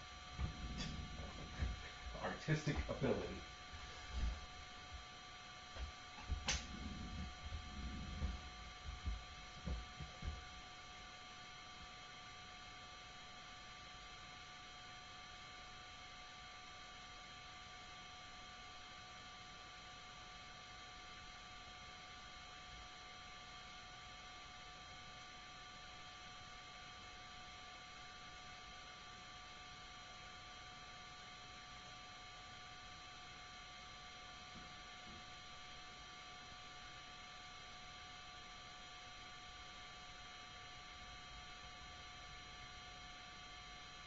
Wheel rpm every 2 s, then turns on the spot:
0, 0, 0, 0, 0, 0, 0, 0, 0, 0, 0, 0, 0, 0, 0, 0, 0, 0, 0, 0, 0, 0.
none